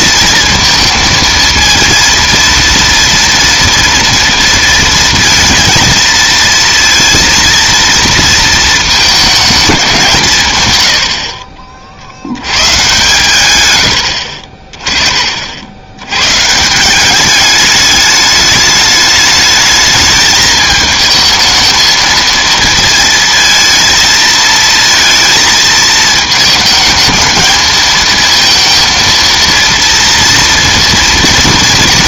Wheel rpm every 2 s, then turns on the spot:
230, 230, 230, 230, 220, 120, 110, 30, 160, 210, 220, 230, 230, 220, 230, 230.
none